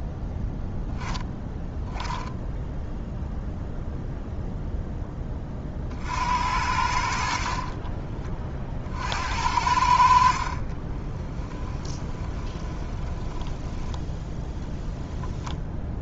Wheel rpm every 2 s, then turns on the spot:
0, 0, 0, 80, 40, 40, 20, 0.
10-14